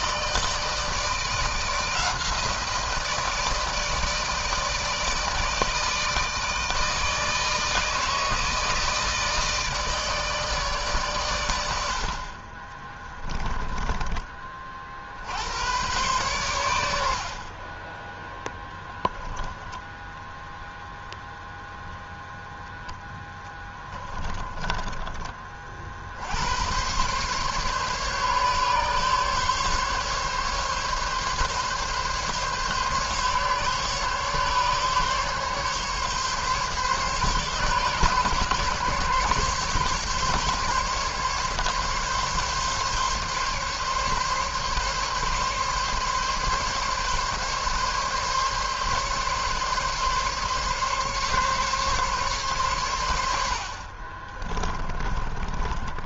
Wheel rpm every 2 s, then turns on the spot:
160, 170, 160, 160, 160, 150, 40, 30, 110, 10, 0, 0, 30, 80, 140, 140, 140, 140, 140, 140, 140, 140, 140, 140, 140, 140, 130, 40.
24-26 54-56